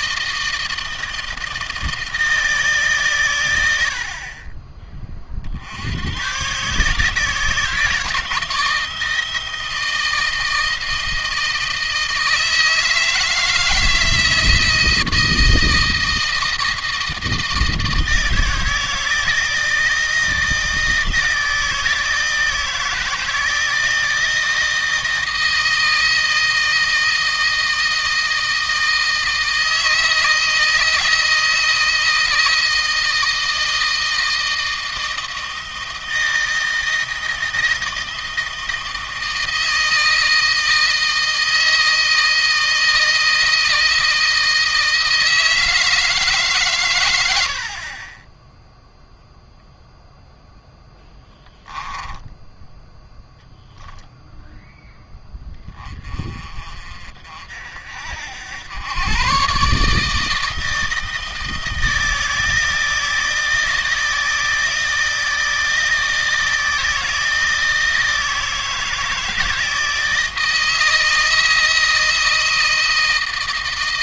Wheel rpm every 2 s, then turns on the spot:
160, 150, 30, 120, 160, 160, 160, 160, 160, 160, 160, 160, 170, 160, 160, 160, 160, 160, 160, 160, 160, 160, 160, 130, 10, 0, 10, 0, 40, 90, 160, 160, 160, 160, 160, 160, 160.
none